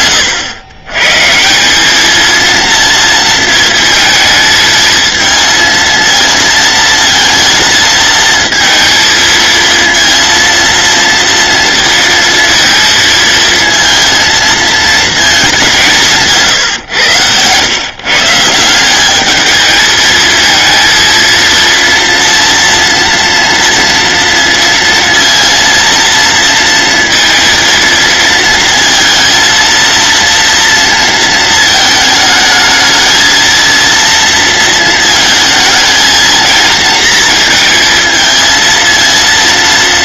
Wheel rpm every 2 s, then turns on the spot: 110, 230, 220, 220, 230, 230, 230, 230, 130, 180, 230, 230, 230, 230, 230, 230, 220, 220, 230, 230.
none